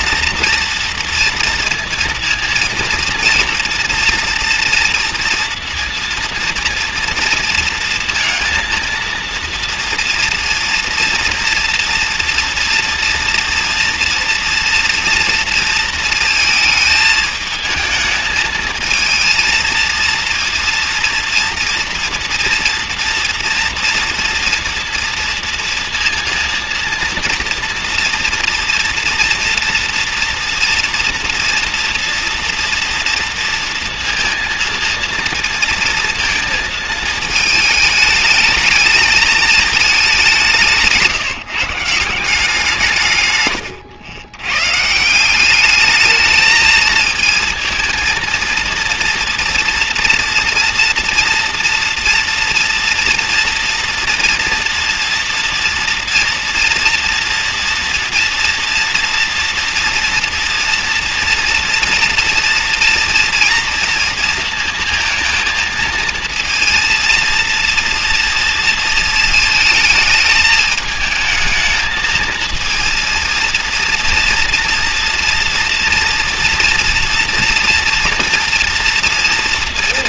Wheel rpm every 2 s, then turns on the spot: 230, 230, 230, 230, 230, 230, 230, 230, 220, 230, 230, 230, 230, 230, 230, 230, 230, 230, 220, 210, 160, 130, 170, 220, 230, 230, 240, 230, 230, 230, 230, 230, 230, 230, 220, 220, 230, 240, 240, 230.
none